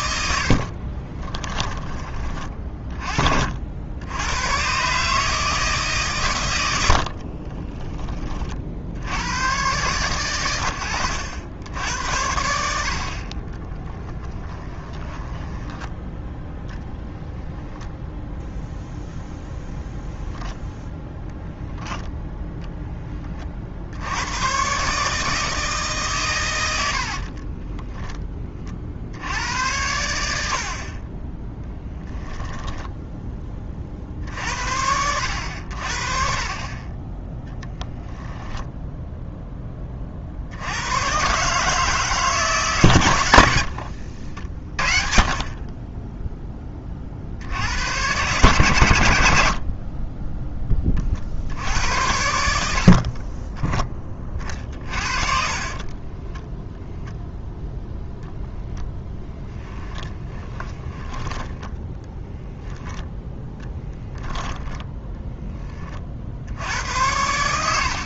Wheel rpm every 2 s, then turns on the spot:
40, 30, 130, 90, 70, 100, 60, 20, 10, 0, 0, 10, 130, 90, 40, 50, 10, 60, 30, 0, 90, 130, 30, 30, 120, 20, 60, 40, 0, 0, 10, 20, 10, 80.
0-2 6-8 14-16 32-34 52-56 60-62 64-66